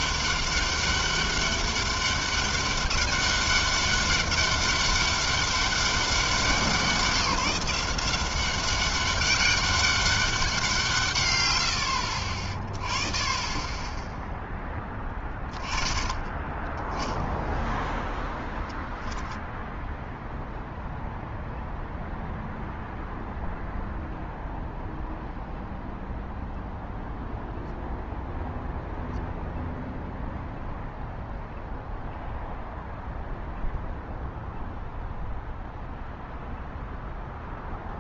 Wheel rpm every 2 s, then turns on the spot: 200, 200, 200, 180, 200, 120, 30, 20, 0, 10, 0, 0, 0, 0, 0, 0, 0, 0, 0.
none